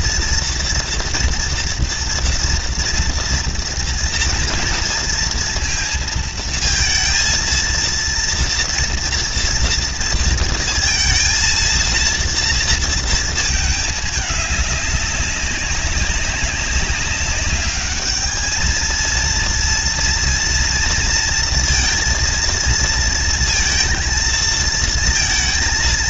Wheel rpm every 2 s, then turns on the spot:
230, 230, 230, 230, 230, 230, 230, 210, 200, 210, 230, 230, 230.
none